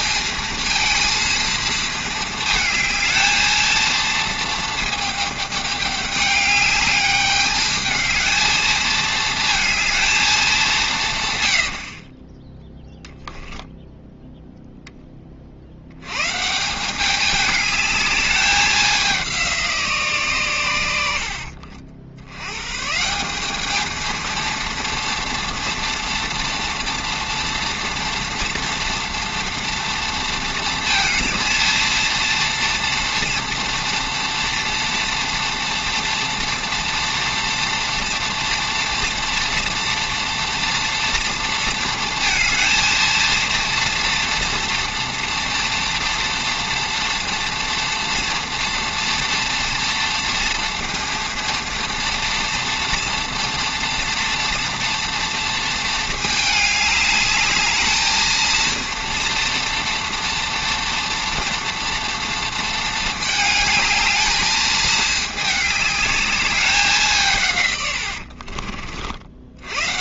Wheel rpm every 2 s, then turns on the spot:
230, 220, 220, 210, 220, 190, 10, 0, 170, 200, 110, 120, 230, 230, 230, 230, 240, 230, 230, 230, 240, 230, 230, 230, 230, 230, 230, 230, 210, 230, 230, 220, 220, 200, 50.
12-14